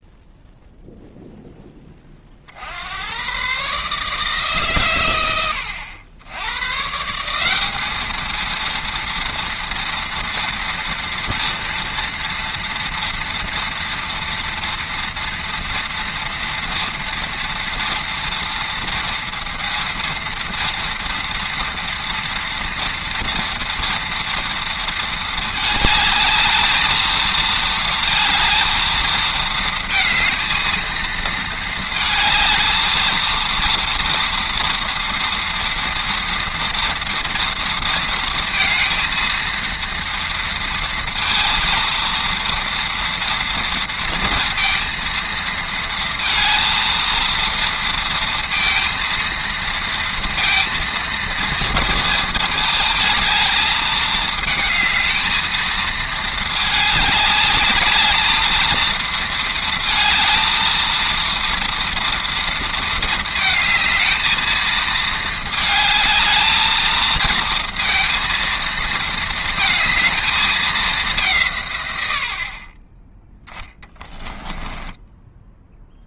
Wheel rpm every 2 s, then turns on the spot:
0, 50, 150, 100, 230, 230, 230, 230, 230, 230, 230, 230, 230, 220, 230, 230, 220, 240, 230, 230, 230, 230, 230, 230, 230, 230, 220, 220, 220, 220, 230, 230, 220, 220, 230, 220, 50, 10.
74-76